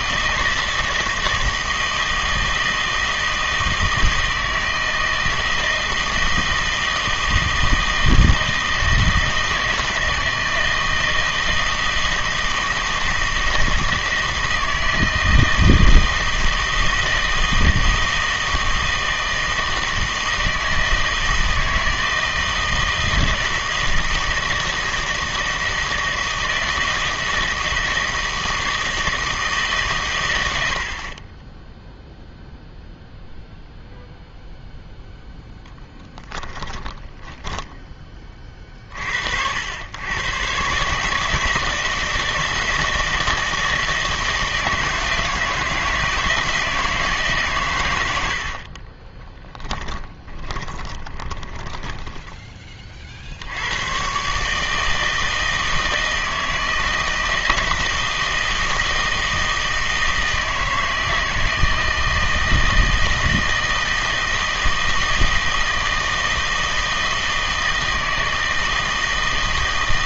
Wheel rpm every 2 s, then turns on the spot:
160, 160, 160, 160, 160, 160, 160, 160, 160, 160, 160, 160, 160, 160, 160, 90, 0, 0, 10, 30, 130, 170, 160, 170, 60, 20, 20, 140, 160, 160, 160, 160, 160, 160, 160.
36-38 48-52